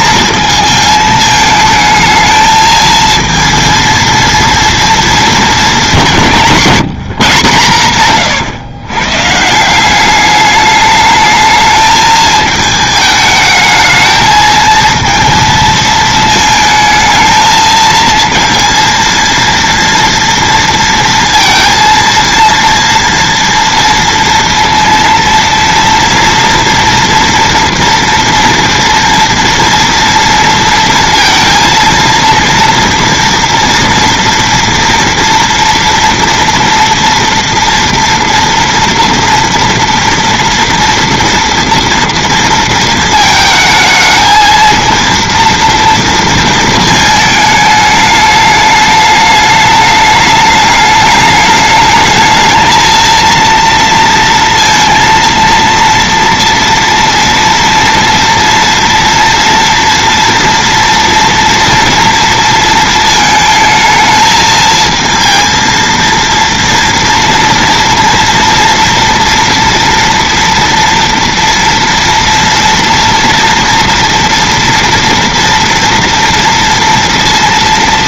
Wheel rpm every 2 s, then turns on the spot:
220, 220, 230, 170, 120, 210, 220, 230, 220, 230, 230, 230, 230, 230, 230, 230, 230, 230, 230, 230, 230, 230, 230, 220, 210, 210, 220, 230, 230, 230, 230, 230, 220, 230, 230, 230, 230, 230, 230.
none